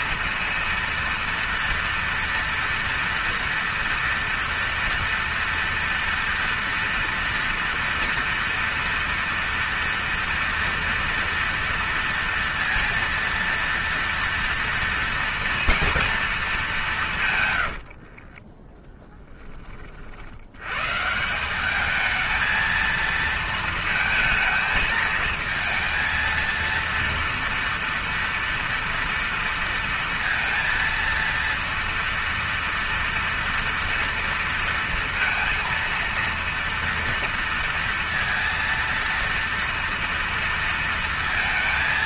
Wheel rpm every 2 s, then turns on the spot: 230, 230, 230, 230, 230, 230, 230, 230, 210, 30, 100, 220, 220, 230, 230, 230, 230, 230, 230, 230, 230.
18-20